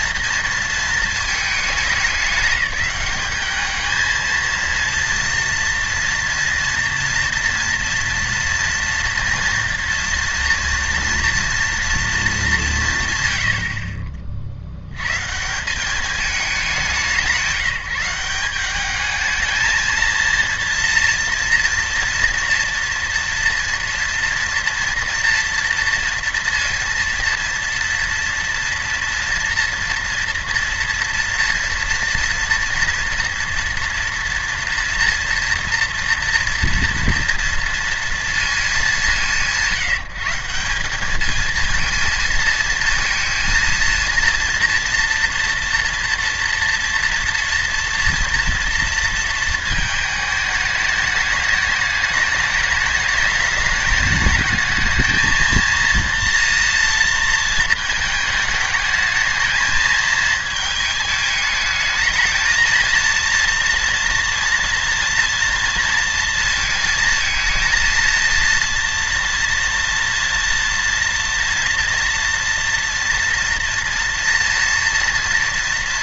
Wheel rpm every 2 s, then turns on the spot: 230, 200, 230, 230, 230, 230, 180, 60, 200, 200, 230, 240, 230, 230, 240, 230, 230, 230, 240, 200, 190, 230, 240, 230, 230, 210, 210, 210, 230, 220, 220, 220, 230, 220, 230, 230, 230, 240.
none